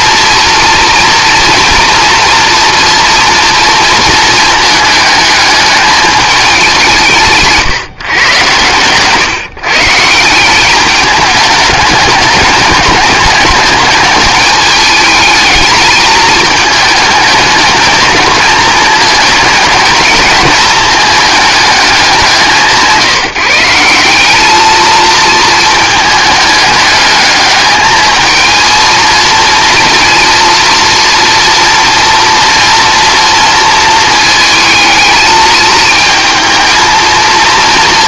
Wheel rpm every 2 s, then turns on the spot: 230, 230, 220, 190, 120, 200, 210, 220, 210, 220, 220, 170, 220, 210, 230, 230, 230, 220, 230.
none